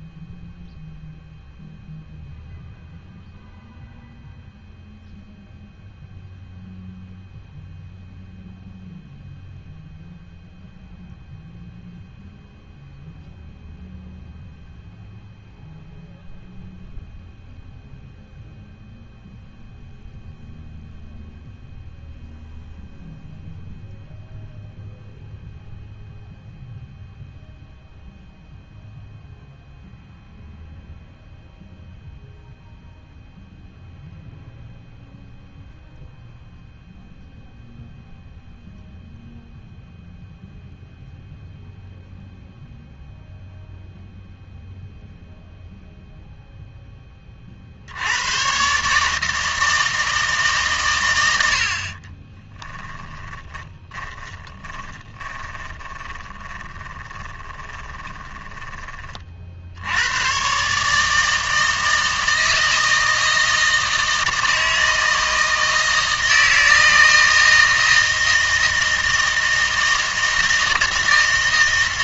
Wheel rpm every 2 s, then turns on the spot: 0, 0, 0, 0, 0, 0, 0, 0, 0, 0, 0, 0, 0, 0, 0, 0, 0, 0, 0, 0, 0, 0, 0, 10, 140, 130, 20, 20, 20, 20, 140, 160, 160, 160, 160, 160.
52-58